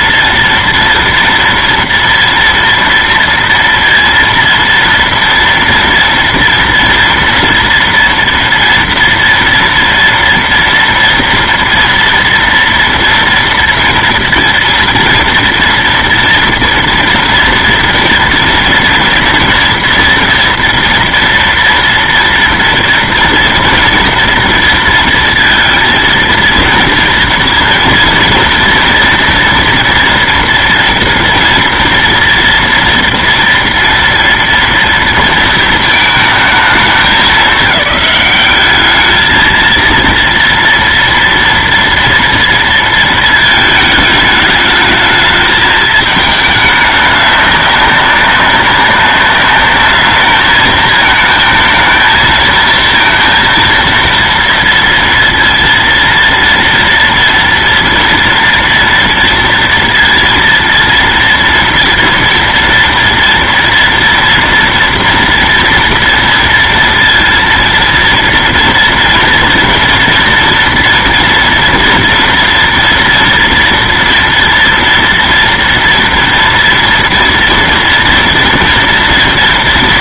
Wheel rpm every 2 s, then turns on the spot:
230, 230, 230, 230, 230, 230, 230, 230, 230, 230, 230, 230, 230, 230, 230, 230, 230, 230, 220, 210, 230, 230, 210, 210, 200, 220, 230, 230, 230, 230, 230, 230, 230, 230, 230, 230, 240, 230, 230, 230.
none